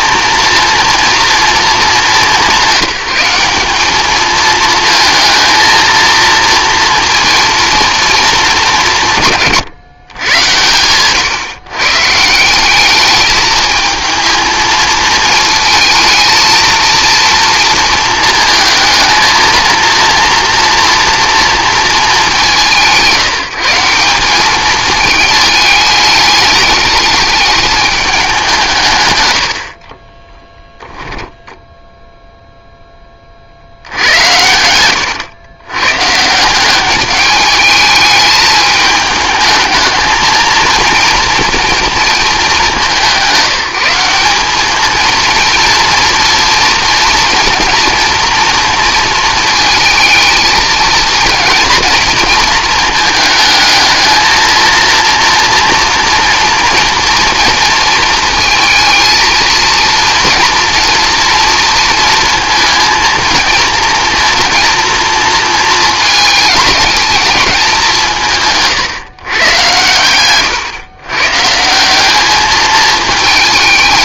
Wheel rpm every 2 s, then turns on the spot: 230, 190, 220, 230, 170, 110, 200, 220, 230, 230, 230, 180, 210, 210, 140, 10, 0, 100, 200, 220, 230, 200, 210, 230, 230, 230, 230, 230, 230, 230, 240, 230, 230, 220, 140, 130, 220.
30-32 34-36